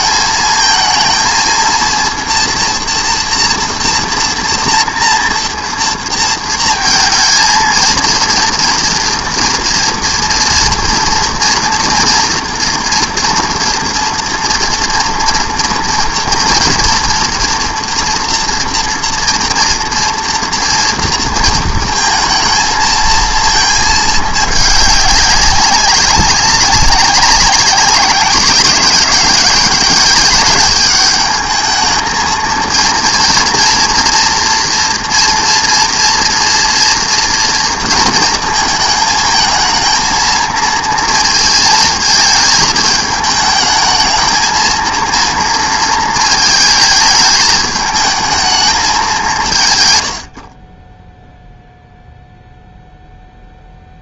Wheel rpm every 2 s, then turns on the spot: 220, 230, 230, 220, 230, 230, 230, 230, 230, 230, 230, 230, 200, 200, 190, 200, 230, 240, 230, 220, 230, 220, 220, 220, 210, 20, 0.
none